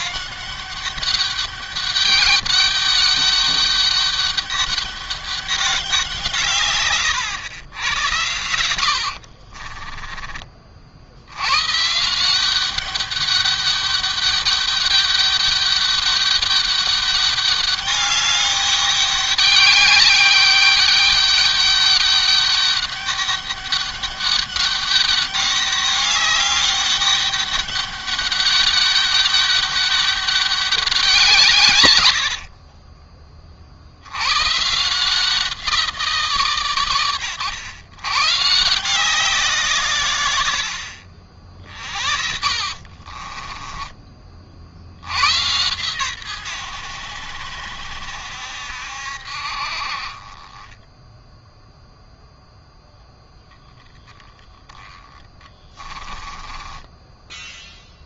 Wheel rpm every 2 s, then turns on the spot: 200, 200, 200, 100, 40, 100, 200, 200, 200, 200, 200, 200, 200, 200, 200, 160, 40, 170, 110, 160, 50, 30, 100, 80, 60, 0, 10, 10, 0.
8-10 42-44 54-56